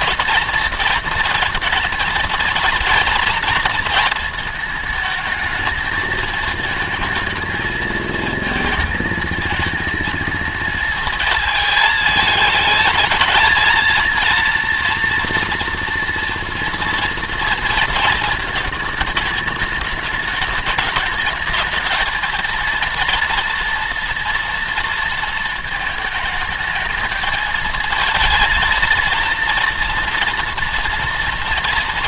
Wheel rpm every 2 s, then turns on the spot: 230, 230, 220, 220, 220, 230, 220, 230, 230, 220, 220, 230, 230, 220, 230, 230.
none